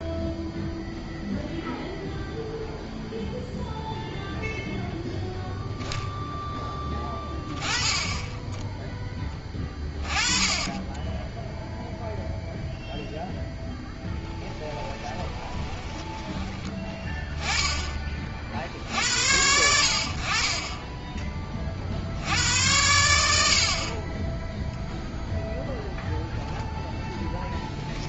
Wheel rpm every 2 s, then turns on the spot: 0, 0, 0, 10, 10, 20, 0, 10, 20, 70, 30, 90, 0, 0.
14-16